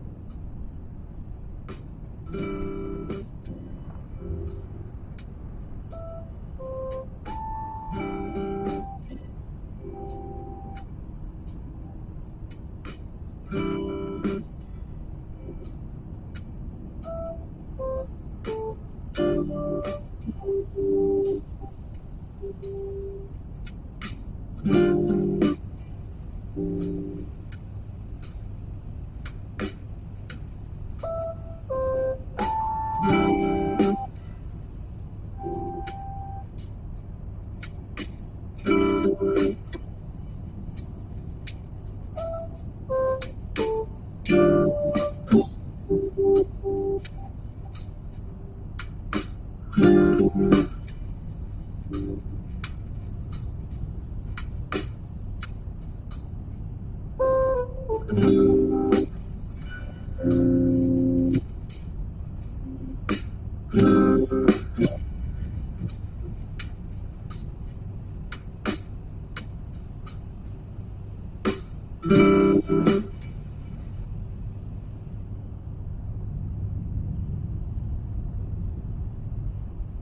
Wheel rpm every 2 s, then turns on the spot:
0, 0, 0, 0, 0, 0, 0, 0, 0, 0, 0, 0, 0, 0, 0, 0, 0, 0, 0, 0, 0, 0, 0, 0, 0, 0, 0, 0, 0, 0, 0, 0, 0, 0, 0, 0, 0, 0, 0, 0.
none